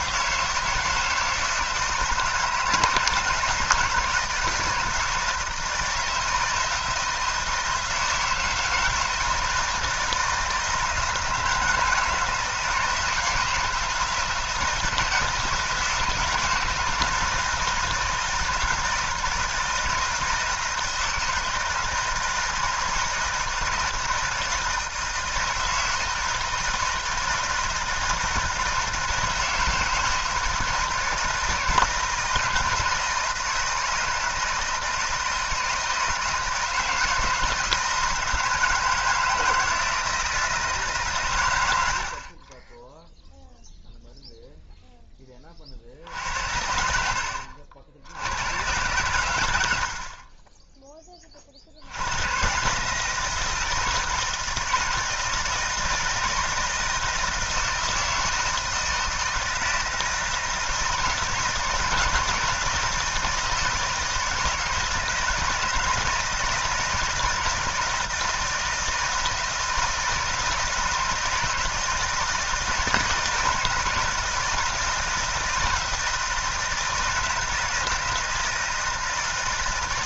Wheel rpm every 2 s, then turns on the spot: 160, 160, 160, 160, 160, 160, 160, 160, 160, 170, 160, 160, 160, 160, 160, 160, 160, 170, 160, 160, 160, 20, 0, 80, 110, 10, 140, 160, 160, 160, 160, 160, 160, 160, 160, 170, 160, 160, 160, 160.
46-48